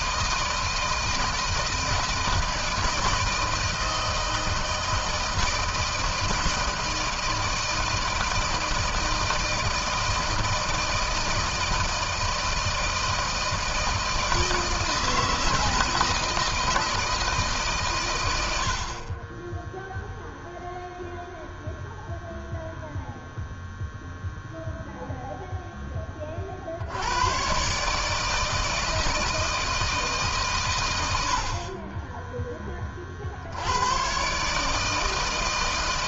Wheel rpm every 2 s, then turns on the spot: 160, 160, 160, 160, 160, 160, 160, 160, 160, 80, 0, 0, 0, 40, 160, 140, 20, 140.
none